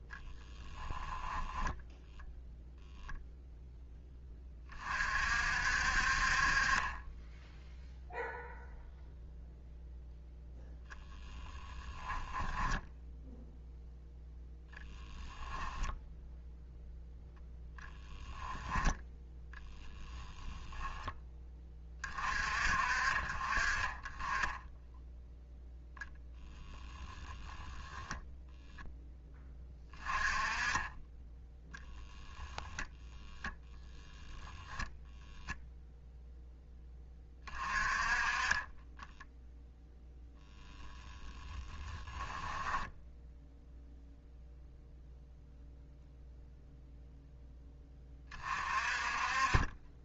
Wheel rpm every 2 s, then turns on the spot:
0, 0, 10, 50, 0, 0, 10, 0, 0, 10, 10, 40, 10, 30, 10, 20, 0, 0, 10, 20, 0, 10, 0, 0, 40.
12-14 26-30 42-44